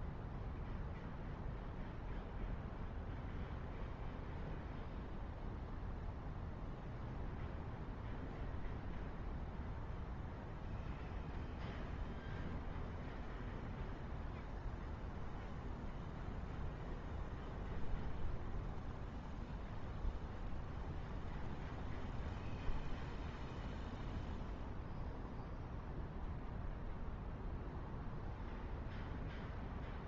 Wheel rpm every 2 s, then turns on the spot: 0, 0, 0, 0, 0, 0, 0, 0, 0, 0, 0, 0, 0, 0, 0.
none